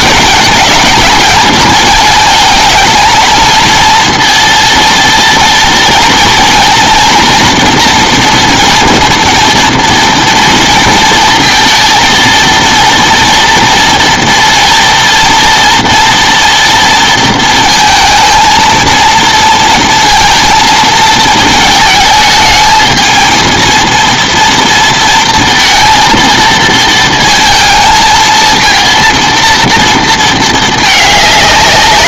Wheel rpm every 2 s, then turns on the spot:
210, 220, 230, 230, 230, 230, 230, 230, 230, 230, 230, 220, 230, 230, 230, 220.
none